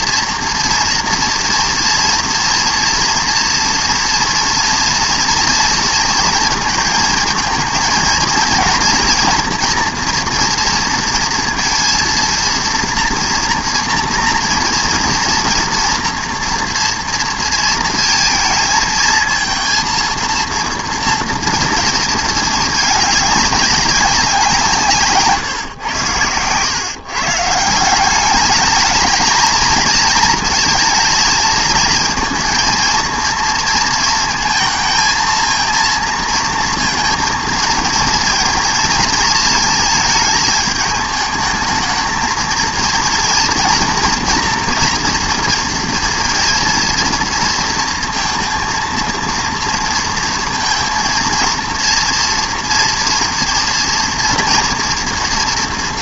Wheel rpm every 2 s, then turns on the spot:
240, 230, 240, 230, 230, 230, 230, 240, 240, 220, 230, 220, 170, 120, 210, 230, 220, 220, 230, 230, 220, 220, 230, 230, 230, 230, 230, 230.
none